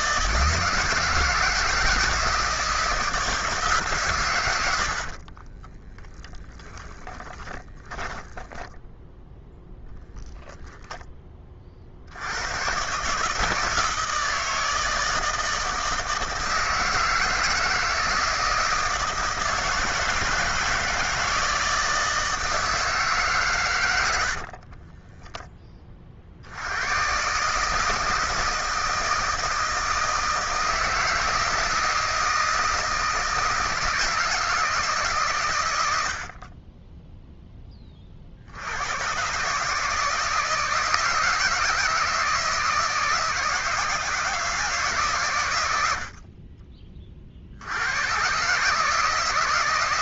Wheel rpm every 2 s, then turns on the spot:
160, 160, 110, 20, 20, 20, 90, 160, 160, 160, 160, 160, 60, 60, 160, 160, 160, 160, 40, 70, 160, 160, 160, 50, 130.
6-12 24-26